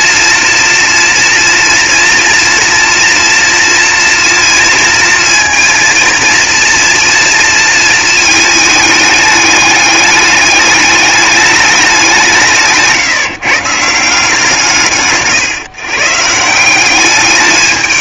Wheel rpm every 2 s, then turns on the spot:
240, 230, 230, 230, 210, 210, 150, 140, 210.
none